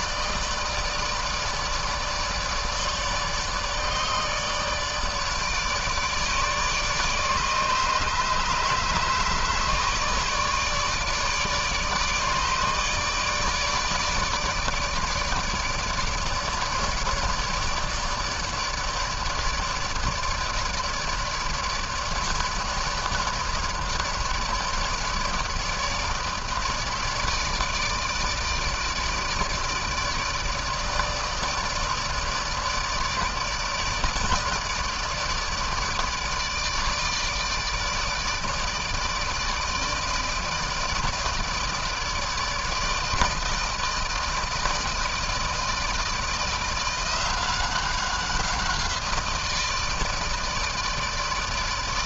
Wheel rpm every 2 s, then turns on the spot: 160, 150, 150, 150, 150, 150, 150, 150, 150, 150, 150, 150, 150, 150, 150, 150, 160, 150, 150, 160, 160, 160, 160, 170, 180, 160.
none